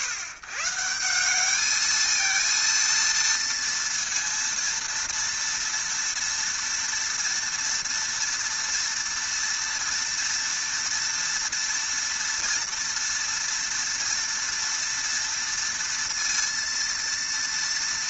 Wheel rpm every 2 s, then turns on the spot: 130, 230, 230, 230, 230, 230, 230, 230, 230.
none